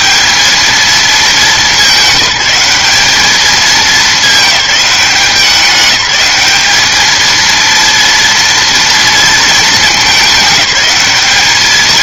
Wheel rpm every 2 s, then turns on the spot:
210, 190, 210, 210, 230, 210.
none